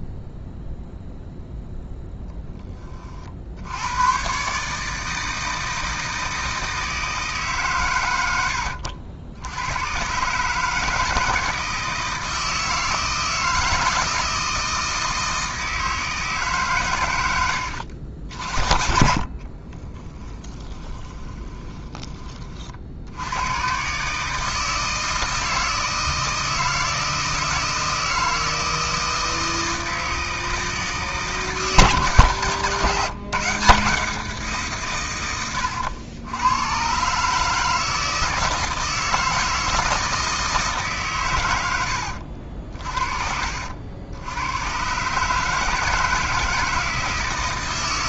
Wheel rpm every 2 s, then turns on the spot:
0, 10, 150, 160, 80, 150, 160, 160, 130, 50, 10, 60, 160, 160, 160, 160, 160, 150, 120, 160, 150, 50, 120, 160.
20-22